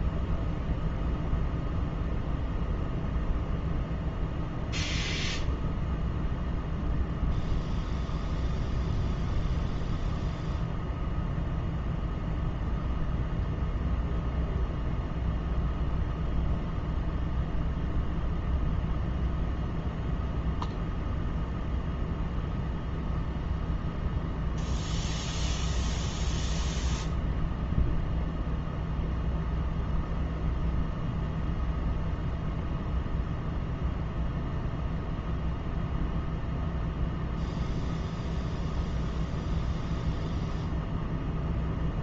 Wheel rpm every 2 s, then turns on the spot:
0, 0, 0, 0, 0, 0, 0, 0, 0, 0, 0, 0, 0, 0, 0, 0, 0, 0, 0, 0, 0.
none